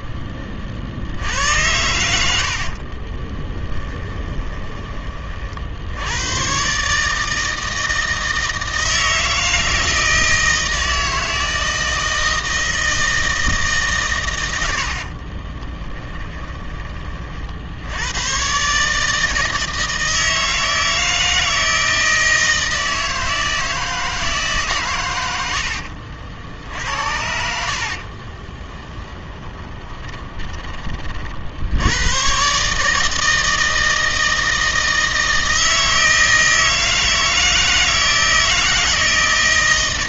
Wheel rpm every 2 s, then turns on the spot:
40, 60, 20, 130, 160, 160, 160, 80, 20, 130, 160, 160, 140, 80, 20, 20, 140, 160, 160, 160.
2-4 28-30